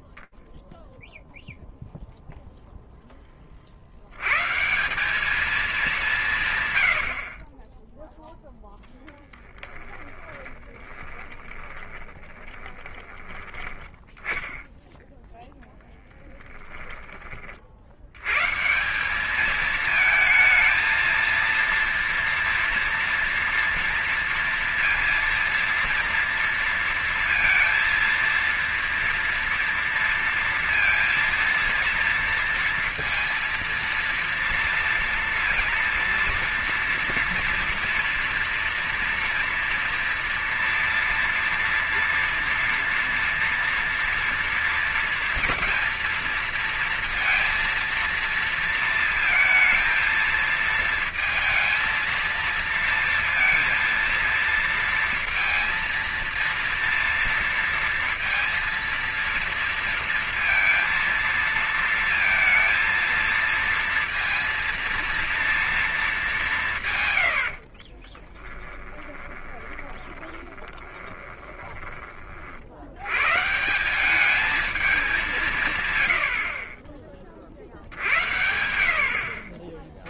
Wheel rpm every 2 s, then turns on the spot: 20, 0, 120, 160, 10, 10, 20, 10, 10, 110, 220, 240, 230, 230, 230, 230, 230, 230, 230, 240, 230, 230, 230, 230, 230, 230, 230, 230, 230, 230, 230, 220, 230, 200, 40, 10, 30, 190, 100, 60.
6-16 68-72